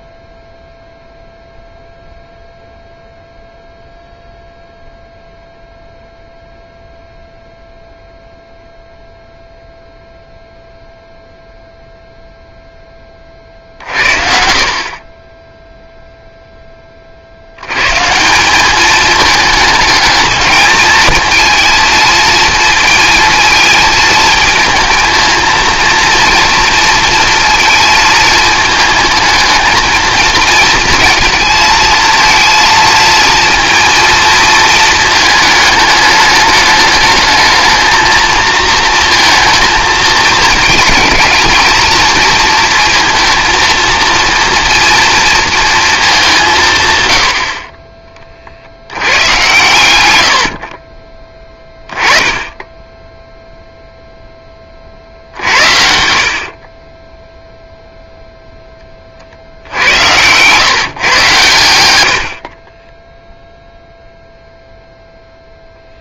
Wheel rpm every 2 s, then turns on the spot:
0, 0, 0, 0, 0, 0, 0, 50, 10, 200, 220, 230, 220, 230, 220, 220, 230, 230, 210, 230, 220, 230, 230, 160, 70, 50, 10, 20, 40, 10, 120, 40, 0.
56-58